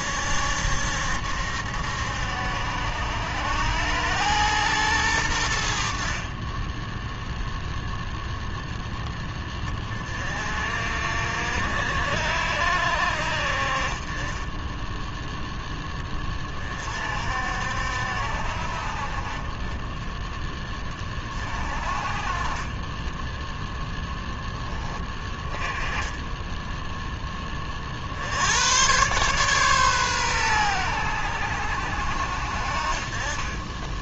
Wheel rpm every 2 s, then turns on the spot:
70, 80, 110, 10, 10, 50, 60, 10, 40, 50, 30, 20, 20, 10, 110, 100, 50.
none